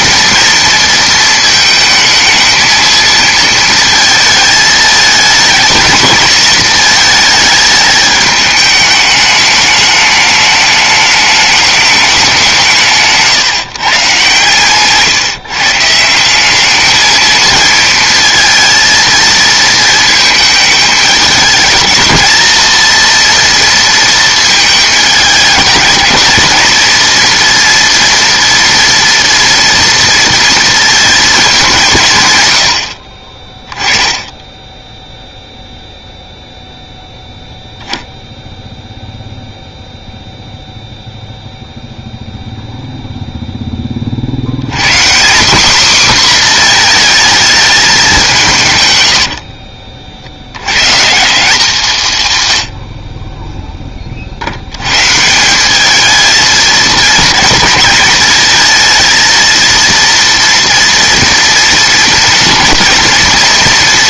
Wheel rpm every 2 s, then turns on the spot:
230, 220, 220, 220, 210, 210, 170, 140, 210, 230, 220, 230, 220, 220, 230, 230, 100, 10, 0, 0, 0, 0, 80, 250, 160, 90, 100, 60, 220, 230, 230, 230.
none